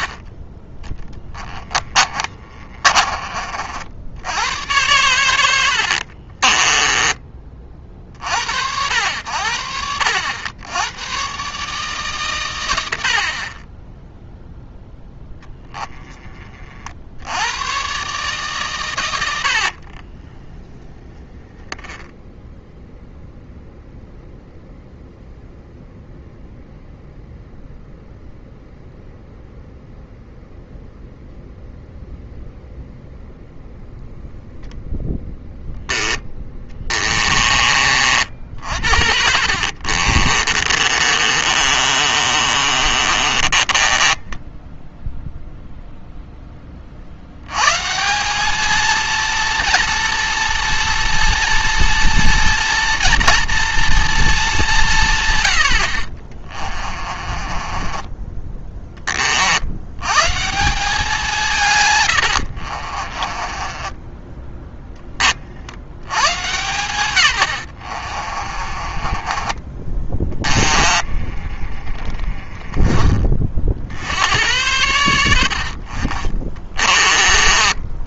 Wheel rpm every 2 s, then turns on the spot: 20, 30, 100, 20, 90, 100, 80, 0, 60, 110, 10, 0, 0, 0, 0, 0, 0, 0, 20, 50, 30, 30, 0, 50, 230, 230, 230, 150, 30, 30, 180, 40, 20, 130, 30, 20, 20, 90, 40.
2-4 6-8 36-44 56-58 62-64 68-72